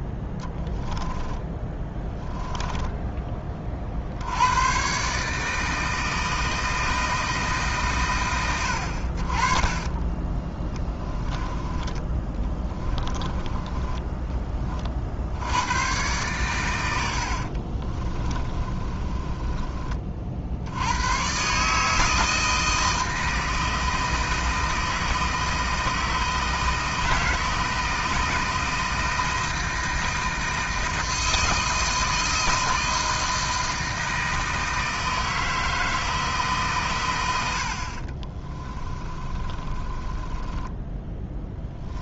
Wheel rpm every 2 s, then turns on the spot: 10, 10, 100, 160, 100, 10, 20, 20, 110, 30, 60, 160, 160, 160, 160, 160, 160, 160, 150, 30, 20.
0-4 10-14 18-20 38-42